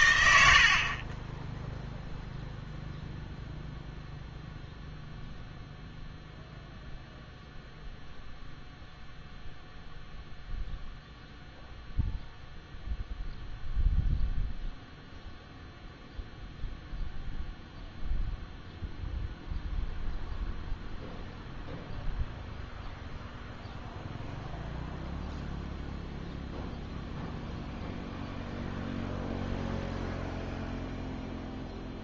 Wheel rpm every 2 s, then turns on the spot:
60, 0, 0, 0, 0, 0, 0, 0, 0, 0, 0, 0, 0, 0, 0, 0.
none